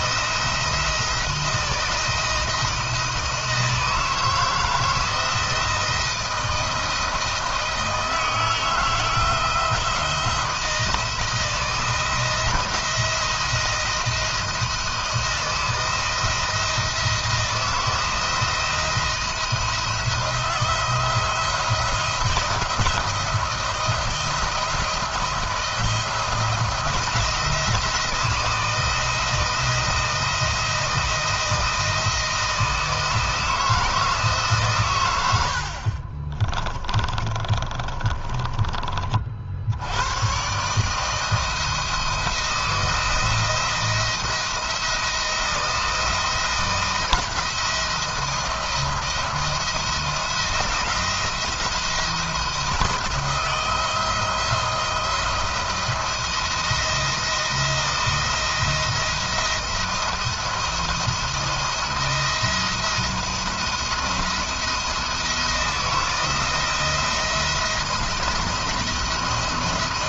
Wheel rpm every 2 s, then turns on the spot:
160, 170, 160, 170, 160, 170, 170, 160, 170, 170, 170, 170, 170, 170, 160, 160, 160, 130, 20, 30, 140, 170, 160, 170, 160, 170, 160, 170, 170, 170, 170, 170, 170, 170, 170.
36-38